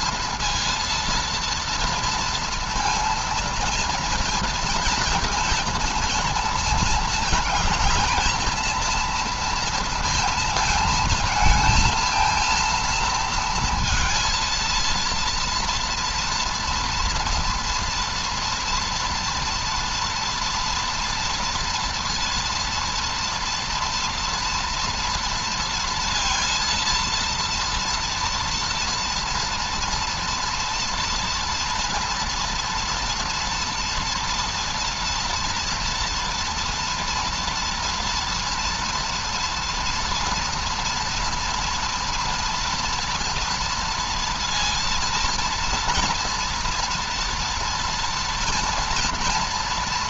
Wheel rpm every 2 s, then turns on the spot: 230, 230, 230, 220, 230, 230, 230, 230, 230, 240, 230, 230, 230, 230, 230, 230, 240, 230, 240, 230, 230, 230, 230, 230, 230.
none